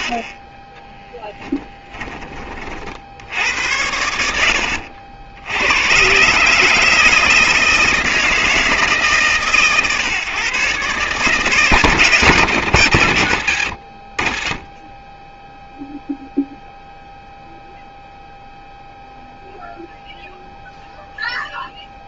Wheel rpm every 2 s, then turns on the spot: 10, 60, 70, 160, 160, 140, 110, 10, 0, 0, 0.
0-2